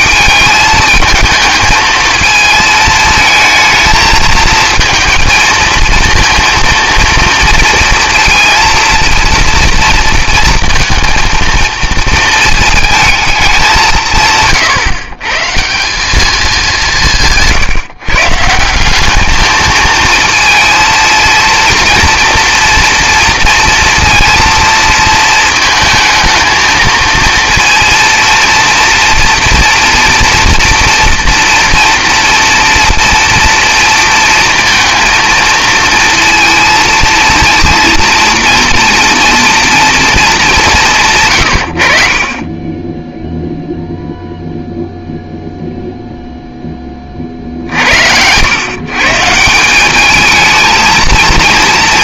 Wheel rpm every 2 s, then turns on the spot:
220, 220, 220, 230, 230, 230, 220, 140, 190, 180, 230, 230, 230, 230, 230, 240, 230, 230, 230, 230, 170, 20, 0, 10, 130, 220.
none